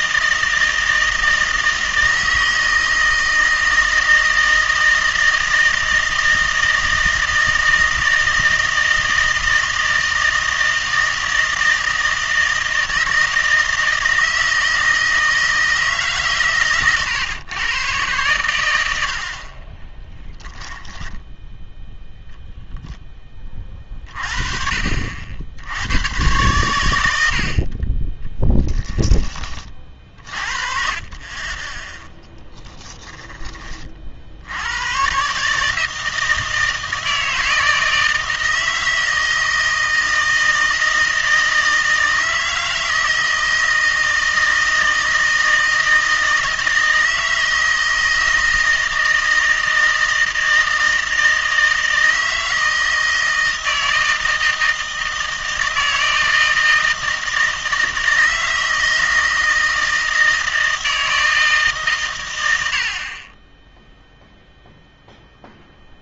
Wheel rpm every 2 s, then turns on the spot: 160, 160, 160, 160, 160, 160, 160, 160, 120, 100, 10, 0, 50, 110, 10, 40, 10, 90, 160, 160, 160, 160, 160, 160, 160, 160, 160, 160, 160, 160, 160, 70, 0.
20-22 28-30 32-34